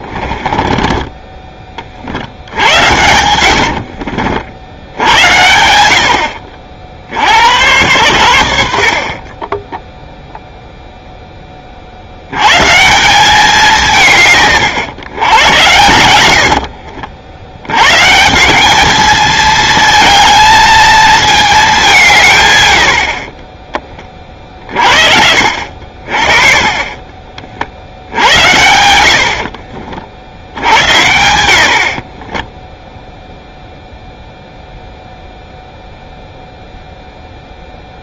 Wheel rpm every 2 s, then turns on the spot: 20, 80, 70, 60, 70, 0, 130, 120, 70, 190, 220, 120, 40, 30, 80, 90, 10, 0, 0.
0-2 16-18 32-34